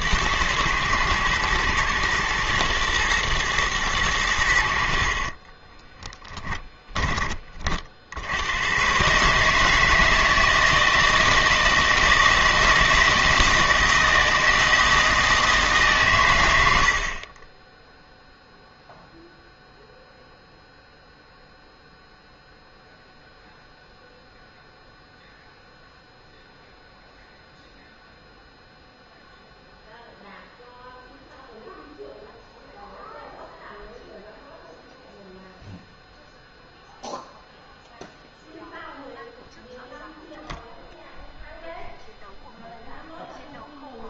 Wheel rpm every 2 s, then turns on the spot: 120, 120, 80, 10, 90, 160, 160, 160, 100, 0, 0, 0, 0, 0, 0, 0, 0, 0, 0, 0, 0, 0.
none